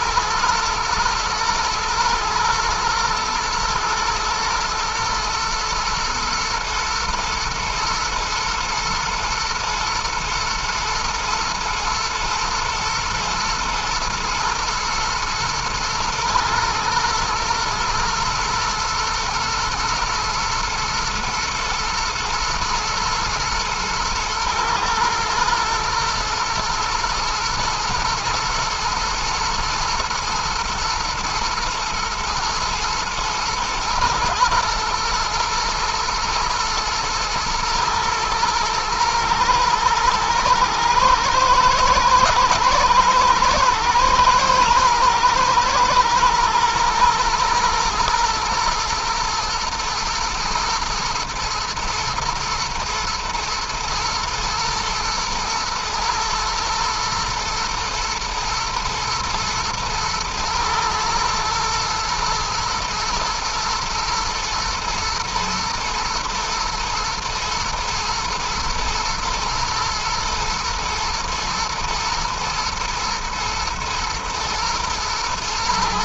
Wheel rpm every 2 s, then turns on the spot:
120, 110, 110, 120, 110, 120, 110, 120, 110, 110, 110, 120, 110, 110, 120, 120, 110, 120, 120, 110, 110, 120, 110, 110, 120, 110, 110, 110, 120, 110, 110, 110, 110, 110, 120, 120, 120, 110.
none